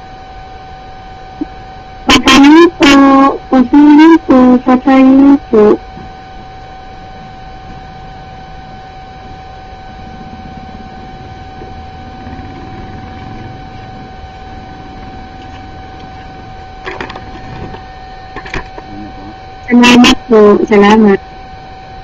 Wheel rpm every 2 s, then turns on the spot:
0, 0, 0, 0, 0, 0, 0, 0, 0, 0, 0.
none